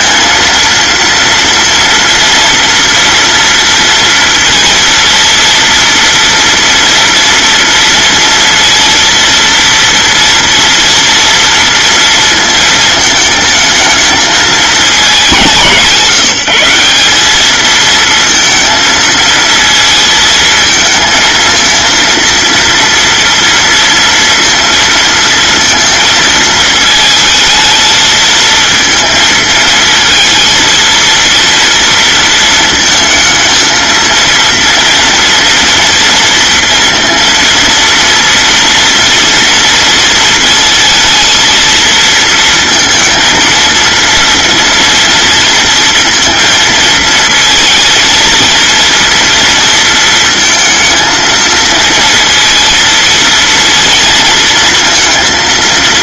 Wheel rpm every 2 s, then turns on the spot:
230, 230, 230, 230, 230, 230, 220, 210, 180, 230, 220, 230, 230, 220, 220, 230, 230, 230, 230, 230, 230, 230, 230, 230, 230, 220, 230, 230.
none